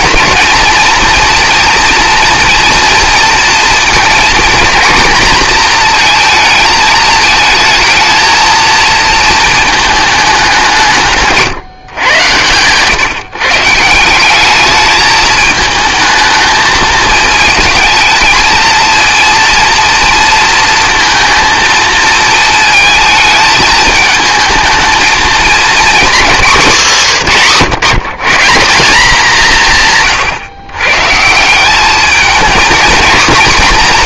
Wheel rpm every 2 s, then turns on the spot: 240, 240, 240, 220, 220, 190, 120, 200, 220, 230, 230, 220, 220, 220, 180, 120, 220.
none